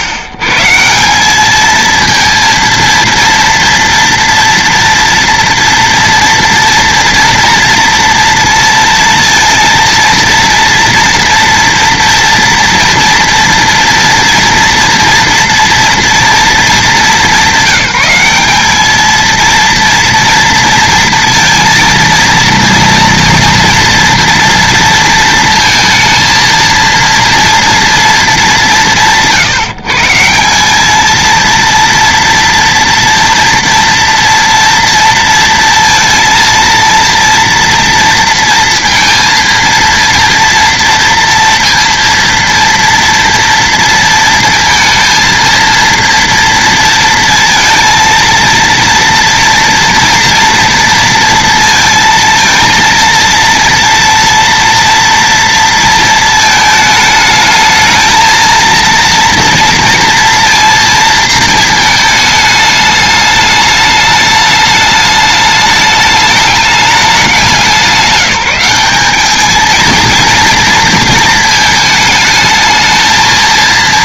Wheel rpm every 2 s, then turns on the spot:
130, 230, 230, 230, 230, 230, 230, 240, 220, 200, 230, 230, 230, 230, 150, 170, 230, 230, 230, 230, 230, 230, 230, 230, 230, 230, 230, 230, 220, 230, 230, 210, 210, 210, 190, 230, 220.
none